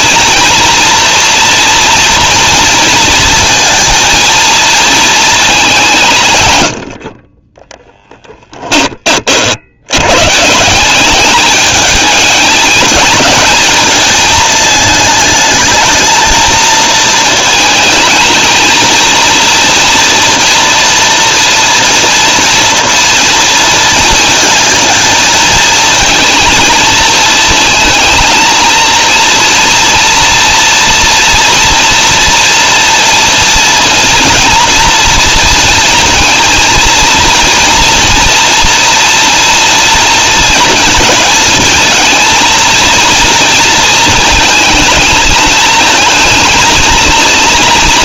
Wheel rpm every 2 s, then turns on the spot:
230, 230, 230, 100, 20, 170, 220, 220, 230, 220, 230, 230, 230, 220, 220, 230, 230, 230, 230, 230, 220, 230, 220, 230.
none